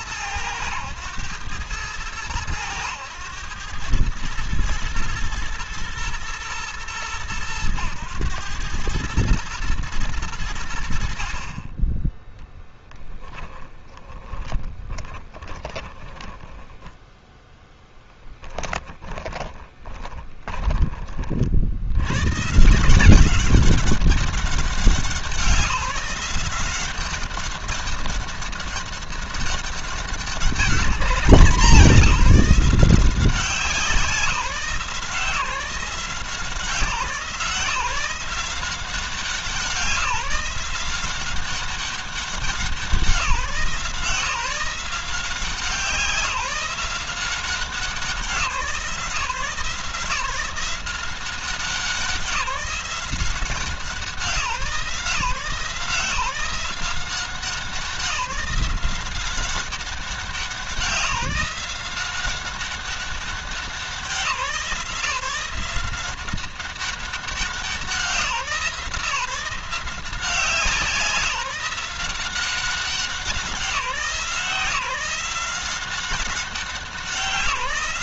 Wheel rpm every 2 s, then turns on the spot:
110, 110, 110, 100, 110, 60, 10, 20, 10, 10, 30, 180, 190, 190, 200, 200, 180, 170, 160, 180, 180, 180, 170, 180, 170, 180, 180, 150, 180, 190, 170, 190, 170, 190, 170, 170, 170, 170, 180.
12-16 18-20